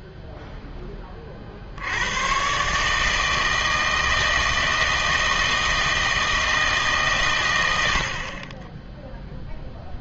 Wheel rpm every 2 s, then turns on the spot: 0, 130, 160, 160, 60.
none